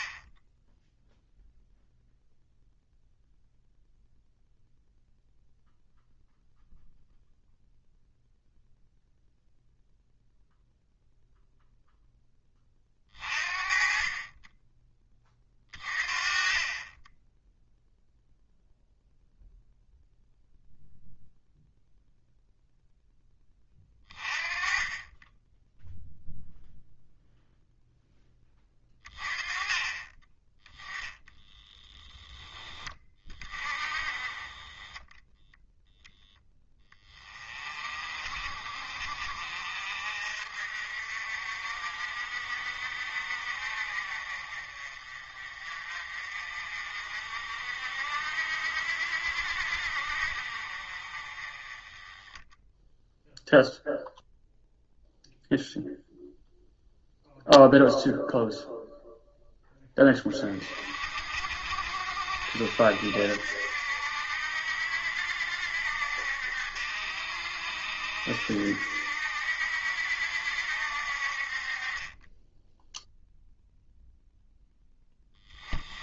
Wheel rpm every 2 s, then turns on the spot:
0, 0, 0, 0, 0, 0, 30, 10, 20, 0, 0, 0, 20, 0, 30, 10, 20, 20, 20, 50, 50, 50, 40, 50, 60, 40, 0, 0, 0, 0, 40, 70, 70, 70, 70, 60, 0, 10.
none